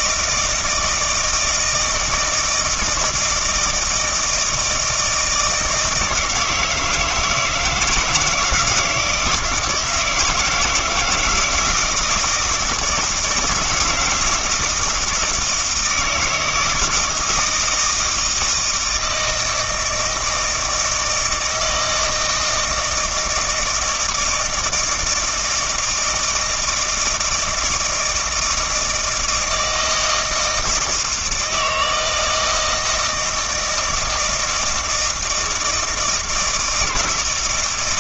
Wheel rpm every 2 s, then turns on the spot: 160, 160, 160, 160, 170, 160, 160, 160, 160, 160, 160, 160, 160, 160, 160, 160, 160, 160, 160.
none